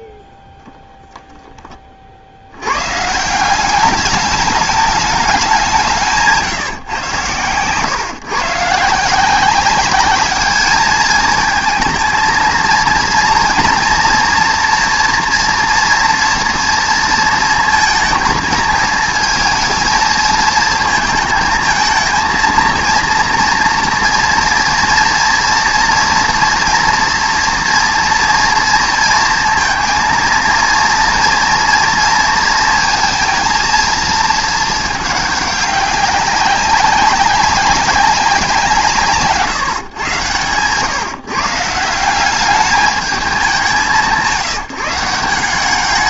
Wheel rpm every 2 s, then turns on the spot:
10, 90, 210, 140, 150, 210, 230, 240, 230, 220, 230, 230, 230, 230, 230, 230, 230, 220, 190, 180, 120, 200, 170.
none